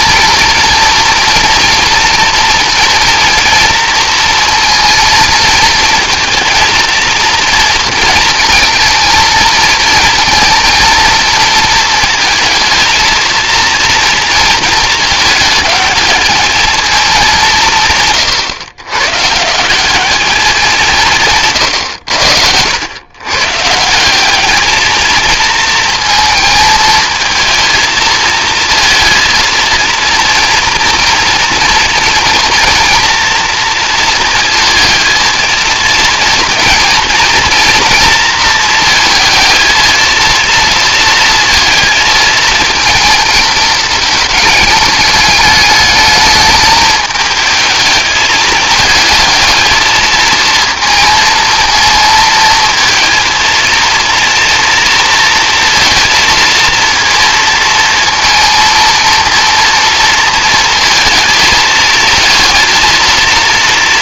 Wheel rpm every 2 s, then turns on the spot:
230, 230, 230, 230, 230, 230, 220, 220, 220, 130, 170, 110, 220, 220, 230, 230, 230, 220, 230, 230, 230, 220, 210, 210, 210, 230, 230, 230, 230, 230, 230, 230.
none